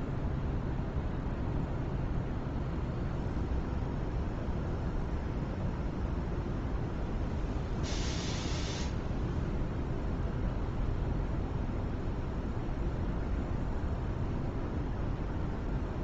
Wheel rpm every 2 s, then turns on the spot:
0, 0, 0, 0, 0, 0, 0, 0.
none